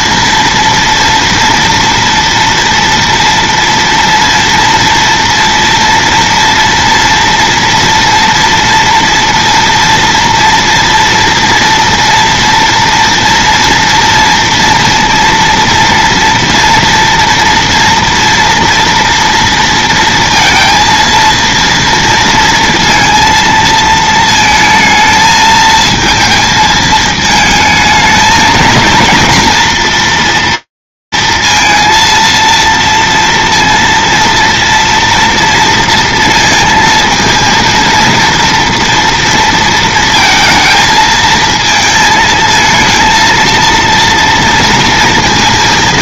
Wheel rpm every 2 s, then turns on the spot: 230, 230, 230, 230, 230, 230, 230, 230, 230, 230, 230, 230, 230, 220, 230, 230, 230, 240, 230, 230, 220, 230, 230.
none